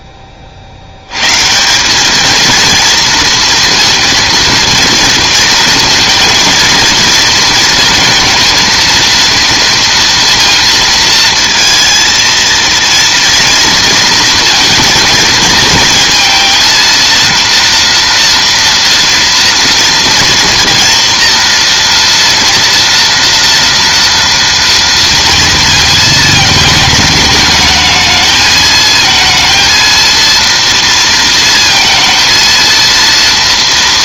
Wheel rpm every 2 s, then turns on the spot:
30, 220, 230, 220, 220, 230, 230, 230, 230, 230, 230, 230, 230, 220, 220, 230, 230.
none